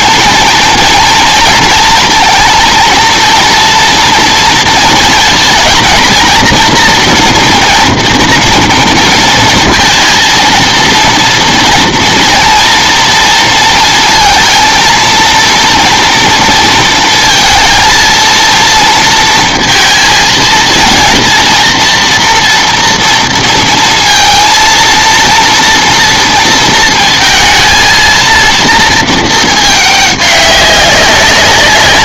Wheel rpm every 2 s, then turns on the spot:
230, 220, 220, 230, 230, 230, 230, 230, 230, 230, 230, 230, 230, 230, 230, 200.
none